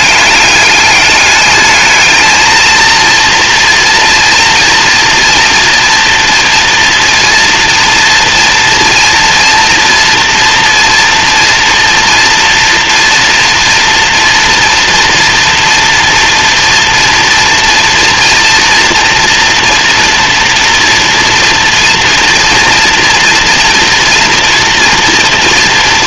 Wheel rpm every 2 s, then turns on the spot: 210, 230, 230, 230, 230, 230, 230, 230, 230, 230, 230, 240, 240.
none